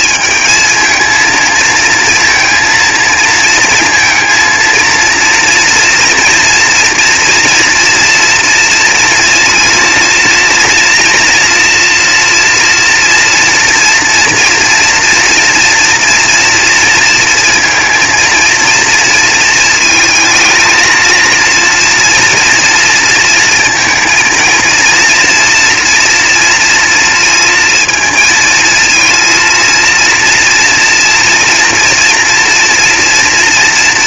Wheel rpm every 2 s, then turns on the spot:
220, 220, 230, 240, 230, 240, 230, 230, 220, 220, 230, 230, 230, 220, 230, 230, 230.
none